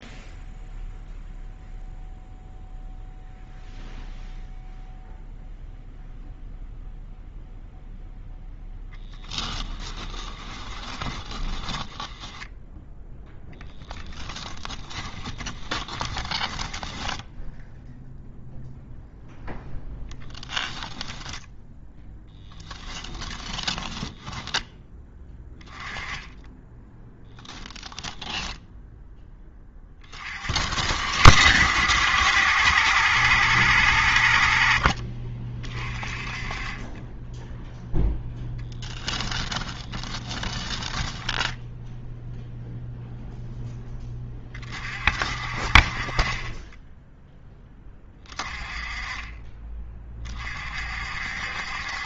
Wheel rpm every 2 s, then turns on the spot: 0, 0, 0, 0, 10, 20, 0, 10, 10, 0, 10, 10, 10, 20, 10, 60, 90, 40, 20, 10, 10, 0, 40, 10, 20, 50.
8-12 14-18 20-24 26-28 38-42